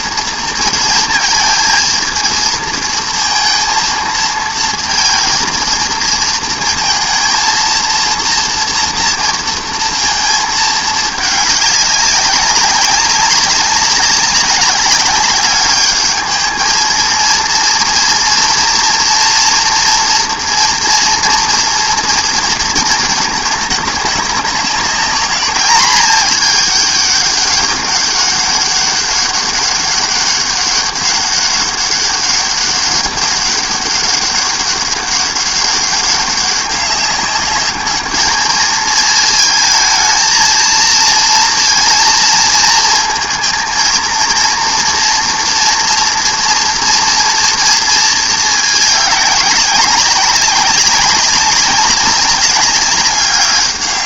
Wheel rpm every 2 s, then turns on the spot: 230, 220, 230, 230, 230, 220, 200, 200, 220, 230, 230, 230, 200, 210, 200, 200, 200, 200, 200, 220, 220, 230, 230, 230, 220, 190, 190.
none